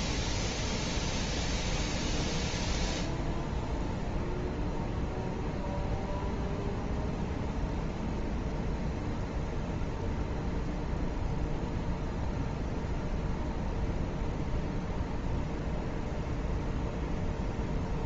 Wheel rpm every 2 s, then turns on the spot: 0, 0, 0, 0, 0, 0, 0, 0, 0.
none